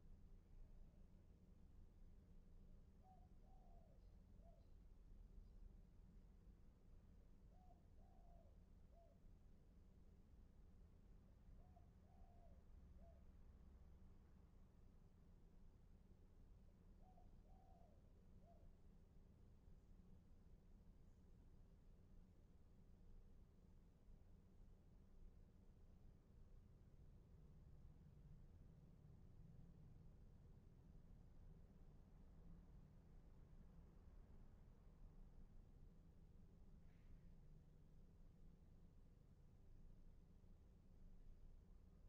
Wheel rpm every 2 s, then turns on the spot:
0, 0, 0, 0, 0, 0, 0, 0, 0, 0, 0, 0, 0, 0, 0, 0, 0, 0, 0, 0, 0.
none